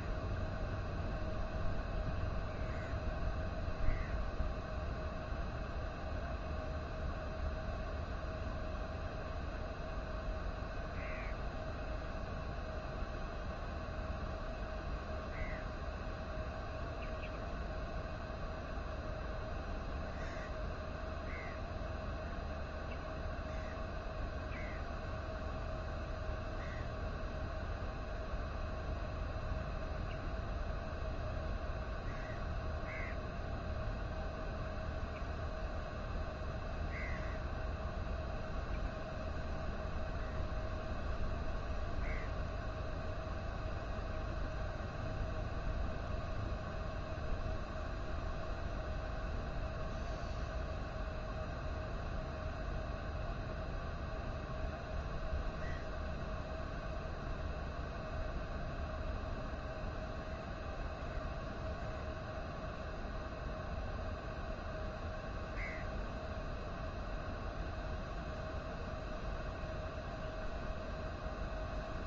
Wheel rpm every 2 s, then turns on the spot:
0, 0, 0, 0, 0, 0, 0, 0, 0, 0, 0, 0, 0, 0, 0, 0, 0, 0, 0, 0, 0, 0, 0, 0, 0, 0, 0, 0, 0, 0, 0, 0, 0, 0, 0, 0.
none